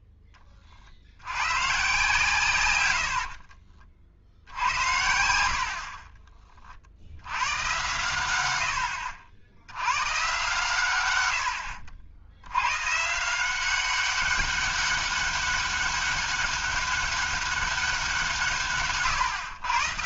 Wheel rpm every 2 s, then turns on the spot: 30, 110, 70, 40, 80, 130, 100, 200, 200, 150.
none